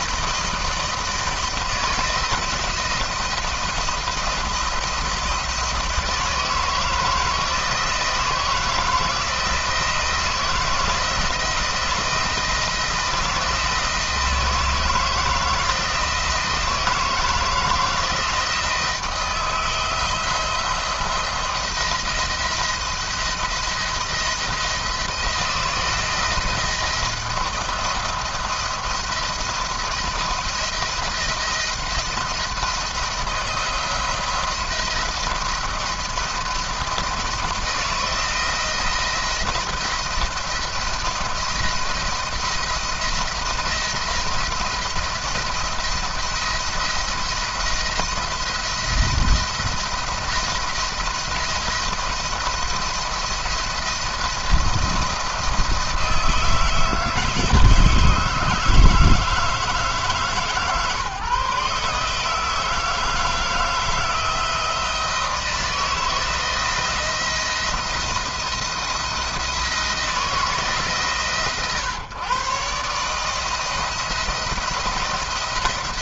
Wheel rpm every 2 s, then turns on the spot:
170, 170, 170, 160, 160, 170, 160, 160, 160, 160, 170, 170, 160, 170, 170, 160, 170, 170, 170, 170, 170, 160, 170, 170, 170, 170, 170, 170, 160, 160, 150, 160, 160, 170, 170, 150, 140, 170.
none